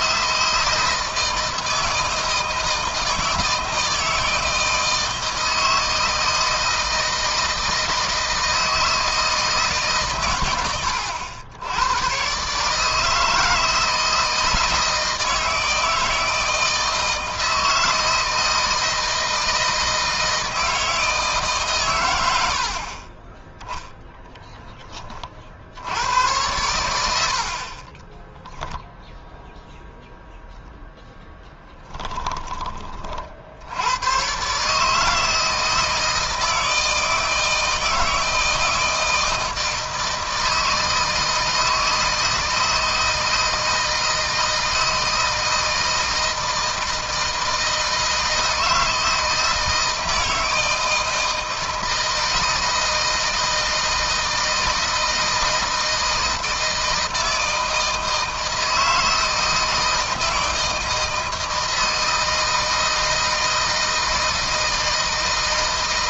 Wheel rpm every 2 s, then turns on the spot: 160, 160, 160, 160, 160, 100, 150, 160, 160, 160, 160, 40, 20, 90, 0, 0, 40, 150, 160, 160, 160, 160, 160, 160, 160, 160, 160, 160, 160, 160, 160, 160, 160.
none